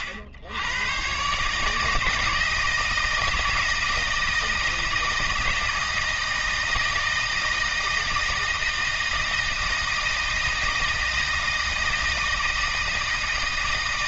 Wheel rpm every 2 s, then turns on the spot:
90, 160, 160, 160, 160, 160, 160.
none